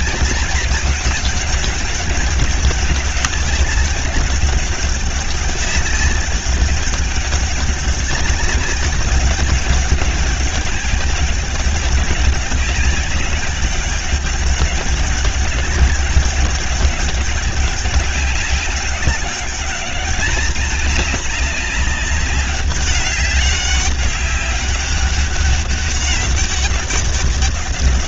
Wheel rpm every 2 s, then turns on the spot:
190, 200, 200, 200, 200, 200, 200, 200, 200, 200, 210, 200, 200, 200.
none